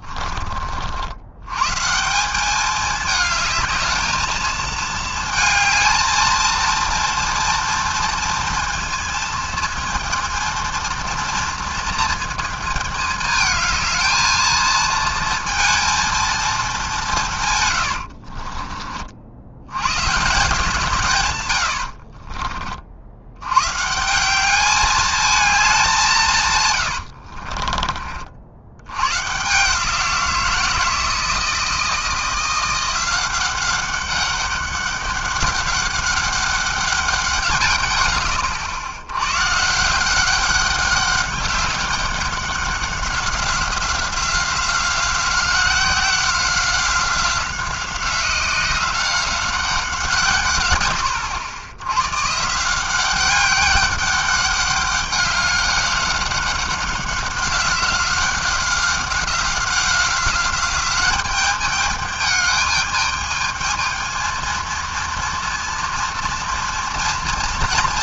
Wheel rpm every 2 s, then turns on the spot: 40, 200, 220, 230, 230, 230, 230, 220, 220, 50, 150, 40, 200, 130, 70, 170, 170, 200, 200, 70, 200, 190, 190, 180, 180, 130, 150, 200, 190, 190, 190, 210, 220, 230.
18-20 26-28